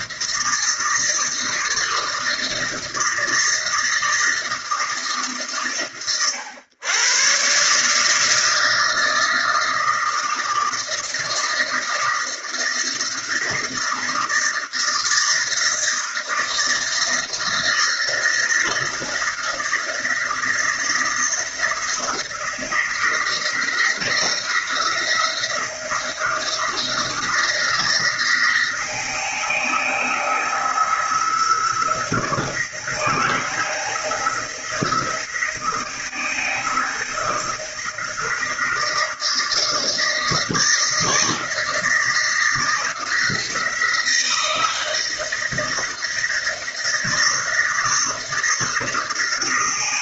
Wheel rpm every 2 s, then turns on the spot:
160, 160, 140, 120, 160, 160, 160, 160, 160, 170, 170, 170, 170, 160, 160, 160, 170, 160, 160, 160, 160, 170, 160, 160, 160.
none